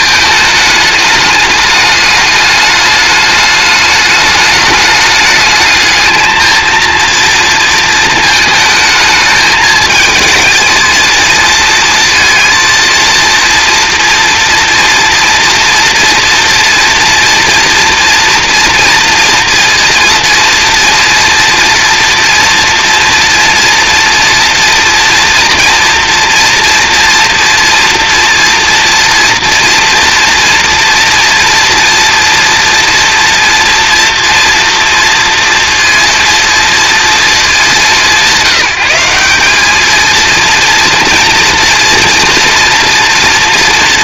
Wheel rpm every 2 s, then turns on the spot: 210, 210, 210, 230, 220, 220, 230, 230, 230, 230, 230, 230, 230, 230, 230, 230, 230, 230, 230, 180, 230, 230.
none